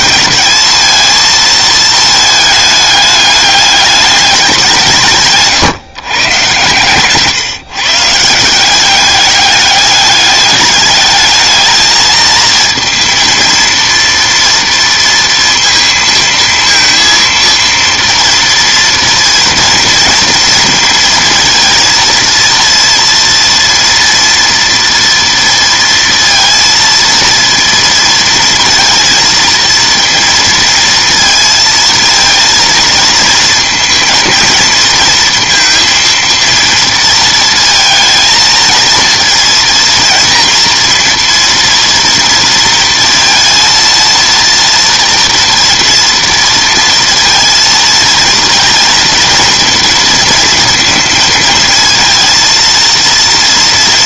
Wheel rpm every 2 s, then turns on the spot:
220, 210, 180, 120, 180, 210, 230, 230, 230, 230, 230, 230, 230, 230, 230, 230, 230, 230, 230, 230, 230, 230, 230, 230, 230, 230, 230.
none